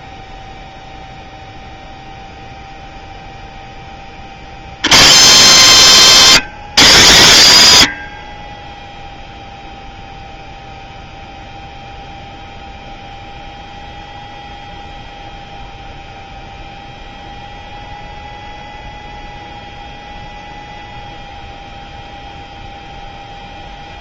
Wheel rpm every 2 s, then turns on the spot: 0, 0, 70, 170, 20, 0, 0, 0, 0, 0, 0, 0.
none